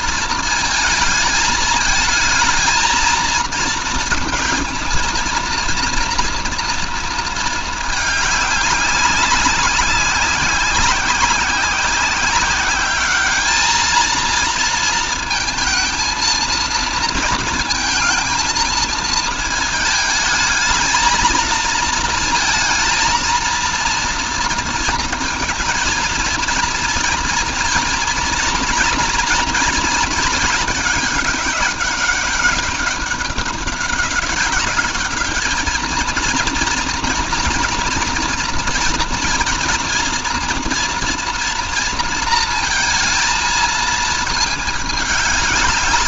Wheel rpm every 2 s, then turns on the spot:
220, 230, 230, 230, 200, 190, 210, 220, 230, 220, 220, 230, 230, 230, 240, 200, 190, 210, 230, 230, 230, 220, 210.
none